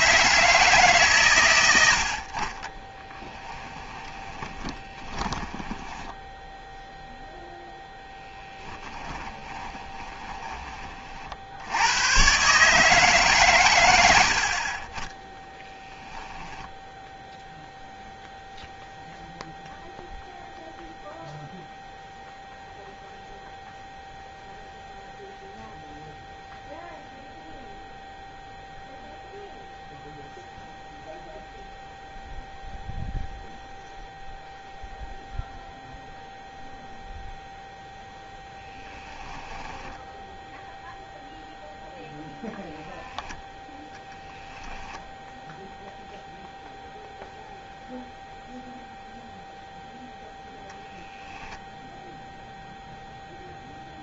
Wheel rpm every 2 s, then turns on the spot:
140, 10, 20, 0, 20, 30, 150, 30, 10, 0, 0, 0, 0, 0, 0, 0, 0, 0, 0, 10, 0, 0, 0, 0, 0, 0, 0.
2-6 8-10 38-40